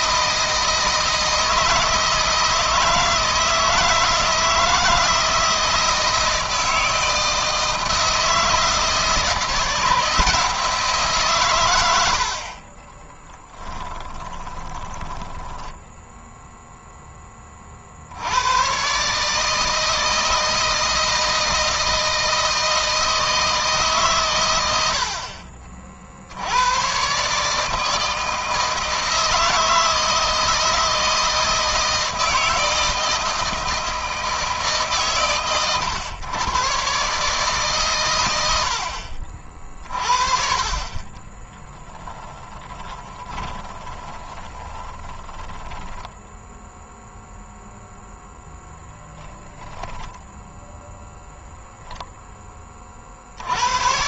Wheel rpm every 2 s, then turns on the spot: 160, 160, 160, 160, 160, 160, 20, 20, 10, 130, 160, 160, 80, 110, 160, 160, 160, 140, 130, 60, 30, 20, 20, 0, 0, 0, 50.
12-16 40-46